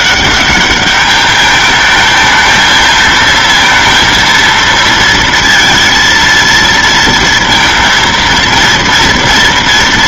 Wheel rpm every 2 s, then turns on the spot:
200, 220, 230, 230, 230.
none